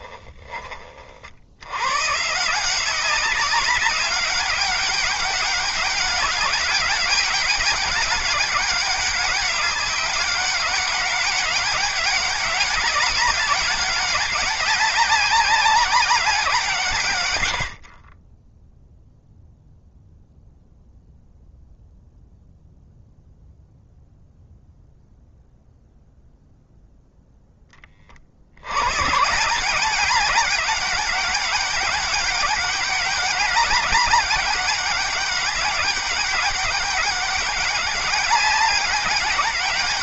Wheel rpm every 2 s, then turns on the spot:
40, 170, 190, 200, 200, 190, 200, 200, 160, 0, 0, 0, 0, 0, 120, 200, 200, 200, 200, 200.
none